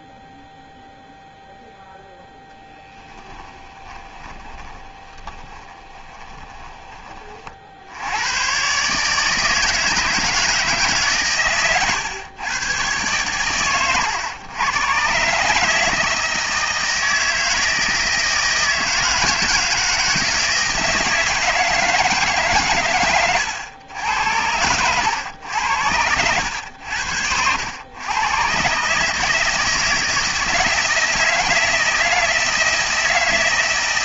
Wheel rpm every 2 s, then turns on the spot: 0, 10, 20, 20, 140, 150, 120, 120, 160, 160, 160, 120, 90, 80, 140, 160, 160.
2-6